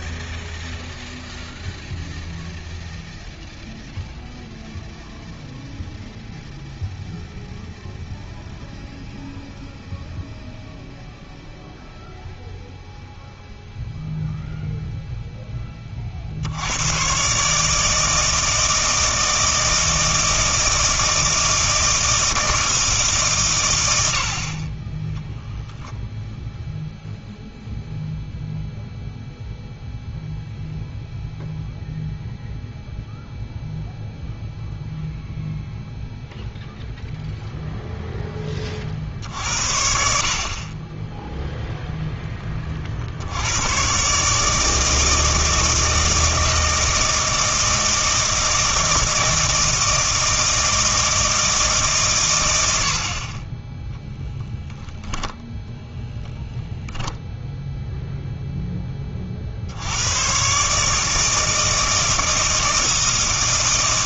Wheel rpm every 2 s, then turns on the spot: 0, 0, 0, 0, 0, 0, 0, 0, 100, 160, 160, 160, 30, 0, 0, 0, 0, 0, 0, 50, 20, 40, 160, 160, 160, 160, 60, 0, 0, 10, 150, 160.
none